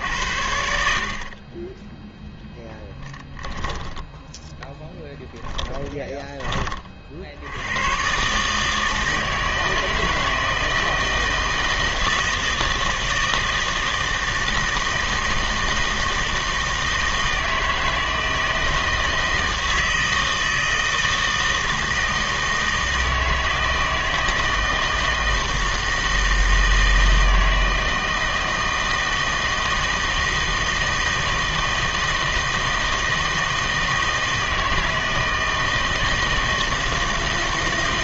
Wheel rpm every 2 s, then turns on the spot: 70, 10, 10, 30, 150, 160, 160, 160, 160, 160, 160, 160, 160, 160, 160, 160, 160, 160, 160.
none